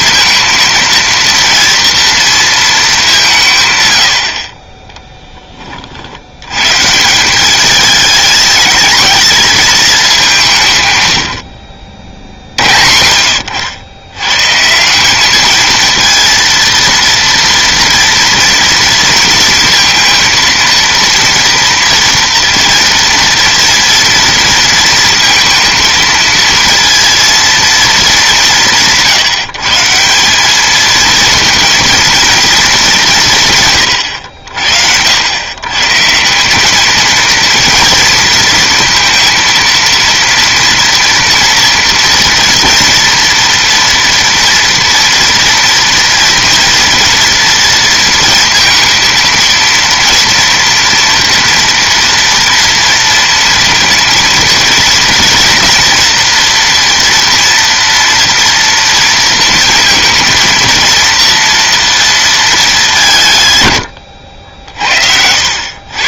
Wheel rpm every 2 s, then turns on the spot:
230, 220, 30, 140, 210, 140, 70, 160, 230, 230, 230, 230, 230, 230, 170, 210, 210, 70, 210, 230, 230, 230, 240, 230, 230, 230, 230, 230, 230, 230, 230, 210, 70.
none